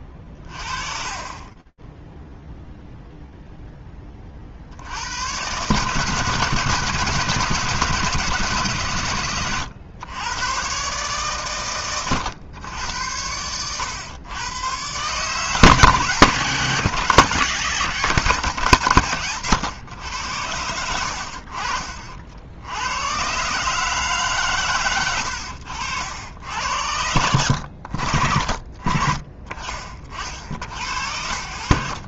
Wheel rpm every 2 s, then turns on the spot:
30, 10, 70, 150, 140, 130, 100, 120, 160, 130, 80, 100, 110, 90, 30, 50.
none